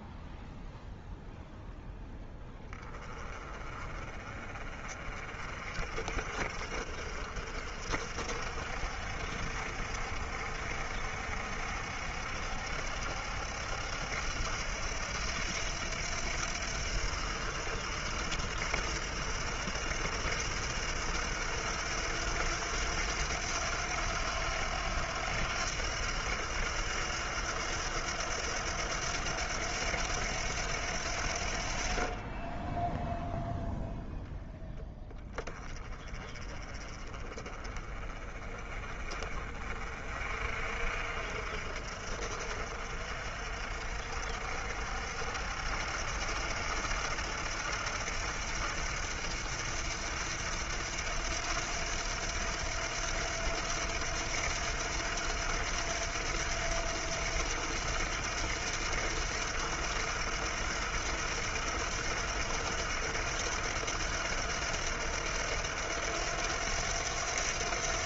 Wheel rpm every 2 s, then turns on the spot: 0, 20, 40, 50, 60, 60, 70, 80, 80, 80, 80, 90, 90, 90, 90, 80, 10, 10, 30, 30, 50, 50, 60, 80, 80, 80, 80, 80, 80, 80, 80, 80, 80, 90.
none